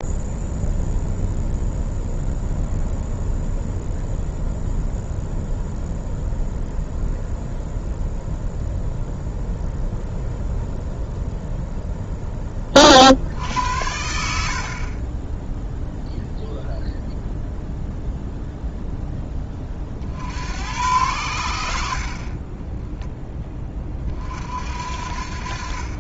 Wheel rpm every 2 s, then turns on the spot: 0, 0, 0, 0, 0, 0, 30, 50, 0, 0, 90, 20, 60.
none